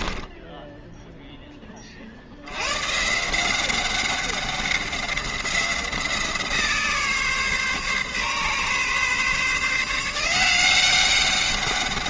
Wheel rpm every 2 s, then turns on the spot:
0, 130, 190, 150, 140, 190.
none